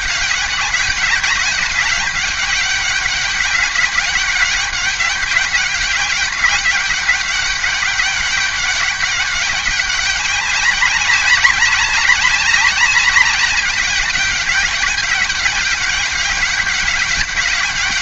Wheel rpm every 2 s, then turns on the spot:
200, 200, 190, 200, 190, 200, 190, 200, 200.
none